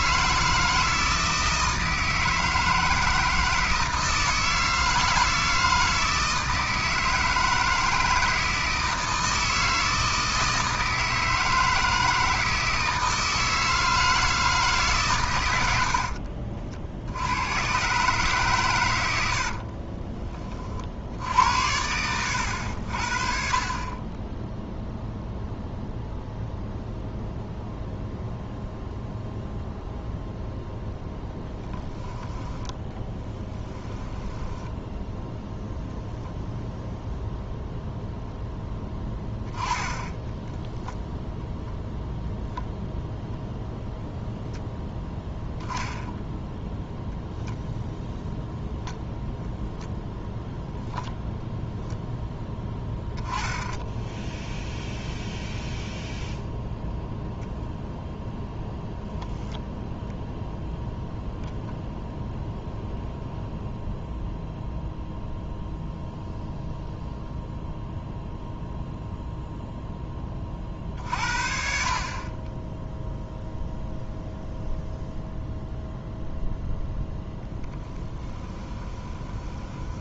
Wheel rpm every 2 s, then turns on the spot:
160, 160, 160, 160, 160, 160, 160, 150, 60, 110, 50, 70, 0, 0, 0, 0, 10, 10, 0, 0, 0, 0, 0, 0, 0, 0, 10, 0, 0, 0, 0, 0, 0, 0, 0, 40, 10, 0, 0, 20.
34-36 78-80